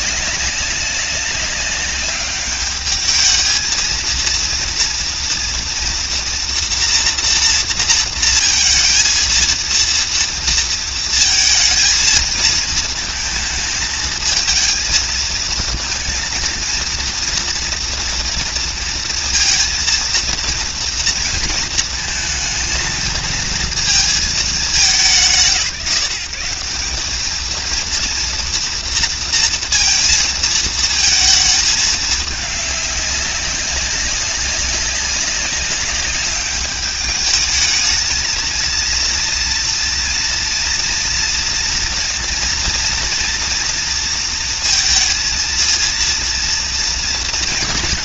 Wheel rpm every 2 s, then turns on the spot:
200, 210, 230, 230, 230, 230, 230, 230, 230, 230, 230, 220, 200, 200, 230, 230, 200, 200, 210, 230, 240, 230, 230, 240.
none